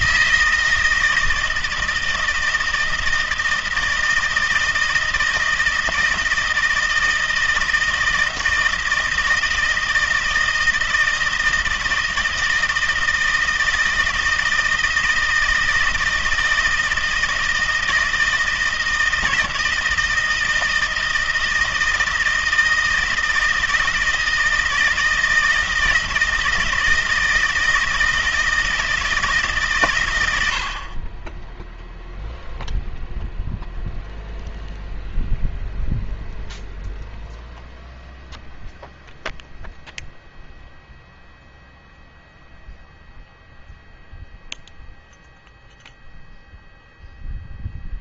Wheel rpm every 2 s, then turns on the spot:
160, 160, 160, 160, 160, 160, 160, 160, 160, 160, 160, 160, 160, 160, 160, 70, 0, 0, 0, 0, 0, 0, 0, 0.
none